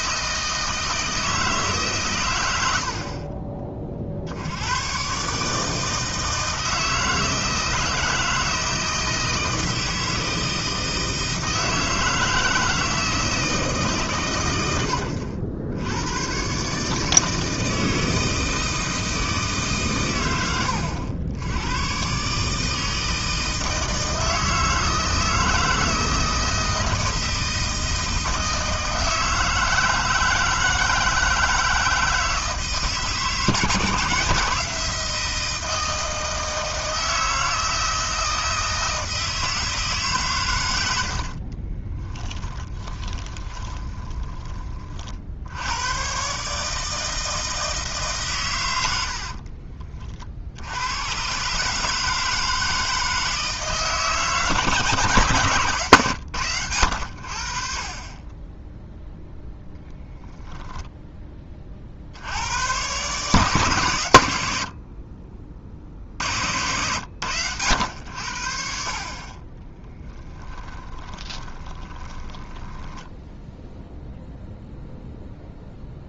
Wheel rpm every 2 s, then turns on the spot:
160, 50, 120, 160, 160, 160, 160, 100, 150, 160, 90, 160, 160, 160, 160, 160, 160, 170, 160, 160, 80, 20, 40, 160, 100, 90, 160, 150, 90, 0, 10, 120, 60, 100, 50, 20, 10, 0.
40-44 70-74